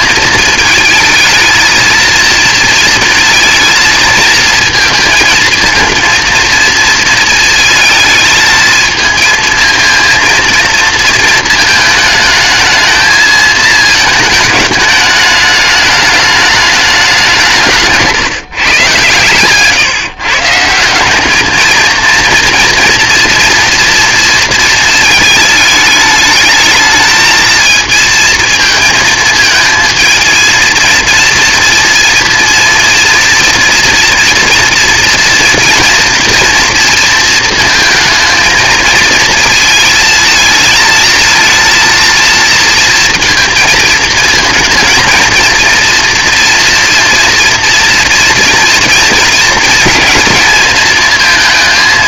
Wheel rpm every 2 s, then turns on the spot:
220, 230, 230, 230, 220, 230, 220, 210, 210, 130, 170, 230, 230, 220, 220, 230, 230, 230, 230, 220, 220, 230, 230, 230, 230, 220.
none